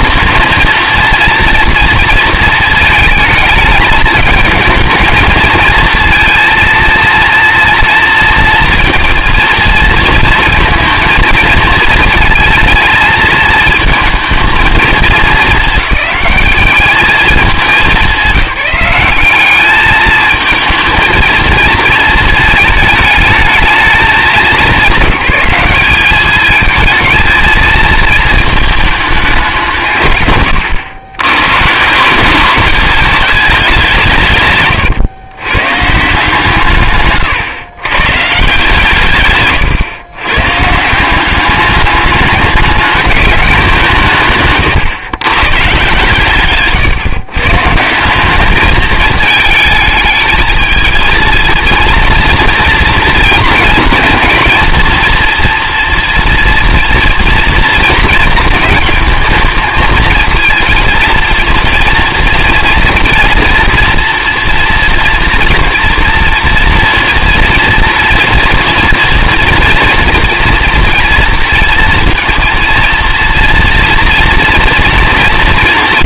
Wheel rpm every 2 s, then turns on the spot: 230, 220, 220, 230, 230, 230, 220, 220, 210, 200, 220, 220, 190, 220, 220, 110, 200, 150, 150, 150, 140, 200, 120, 150, 210, 230, 230, 230, 230, 220, 230, 230, 230, 230, 240, 230, 230, 230.
none